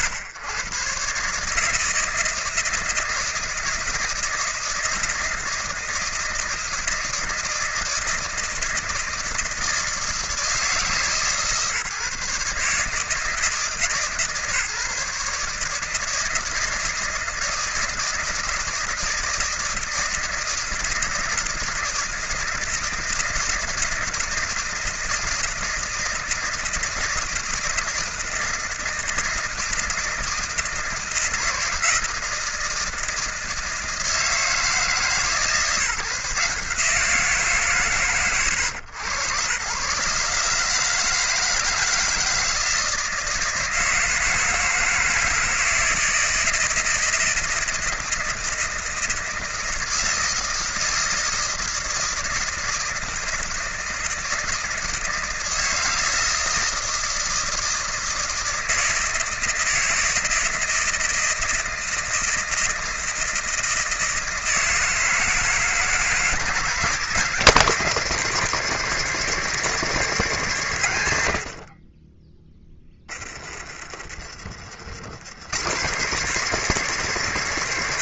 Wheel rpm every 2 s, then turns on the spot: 110, 160, 160, 160, 160, 160, 140, 150, 160, 160, 160, 160, 160, 160, 160, 160, 160, 160, 160, 100, 140, 160, 160, 160, 160, 160, 160, 170, 160, 160, 160, 160, 160, 170, 210, 180, 20, 60, 210.
72-74